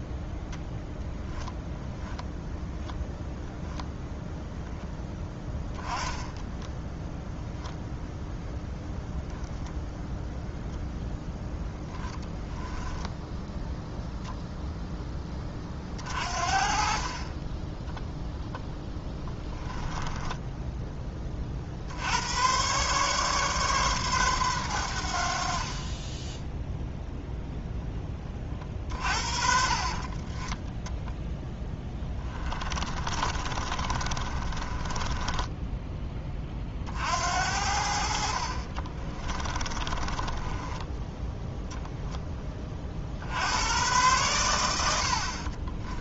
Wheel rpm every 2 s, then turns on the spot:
10, 0, 0, 10, 0, 0, 10, 10, 40, 10, 20, 130, 100, 0, 40, 10, 20, 30, 40, 40, 10, 40, 90.
12-14 28-30 32-36 38-42